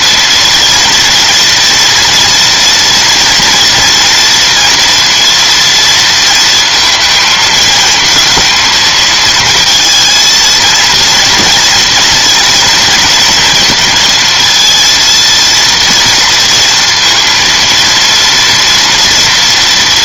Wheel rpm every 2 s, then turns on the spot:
230, 230, 230, 230, 230, 230, 230, 230, 230, 230.
none